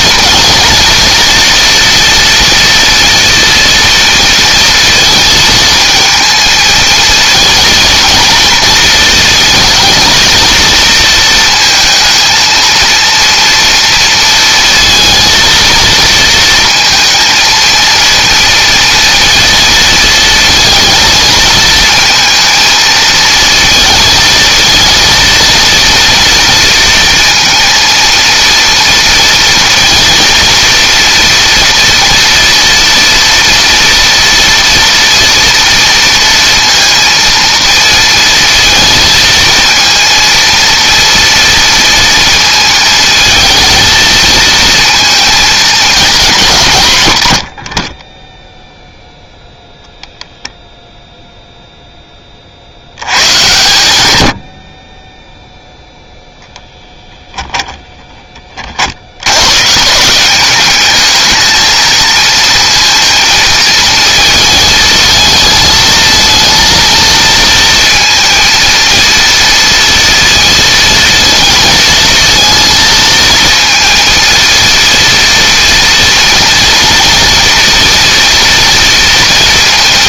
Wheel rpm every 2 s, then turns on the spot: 230, 230, 230, 220, 220, 230, 230, 230, 230, 230, 230, 220, 230, 230, 230, 230, 230, 230, 230, 230, 230, 230, 230, 160, 0, 0, 80, 40, 0, 60, 210, 230, 220, 230, 230, 230, 230, 230, 230, 230.
none